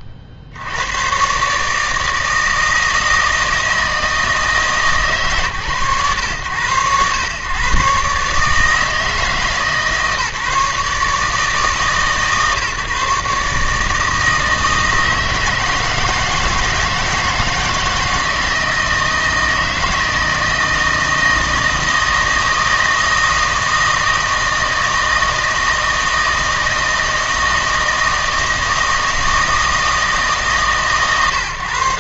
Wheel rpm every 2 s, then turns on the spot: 60, 160, 150, 100, 150, 150, 140, 160, 160, 160, 160, 160, 160, 160, 160, 140.
none